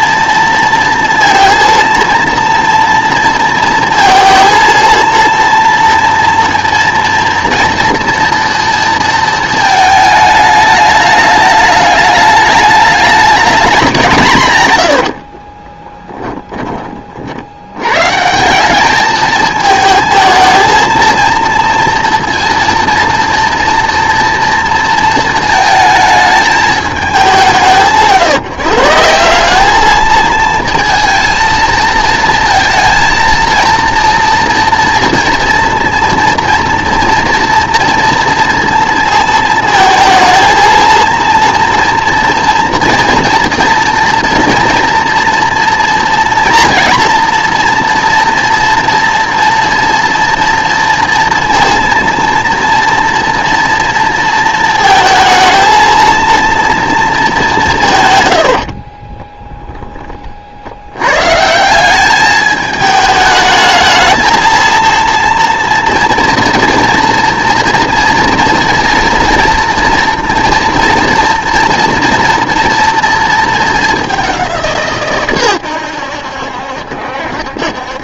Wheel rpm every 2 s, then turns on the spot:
230, 230, 230, 230, 230, 210, 210, 110, 20, 190, 220, 240, 230, 220, 160, 230, 230, 230, 230, 230, 230, 240, 240, 240, 230, 230, 230, 220, 230, 60, 80, 210, 230, 230, 230, 230, 230, 160, 70.
14-16 58-60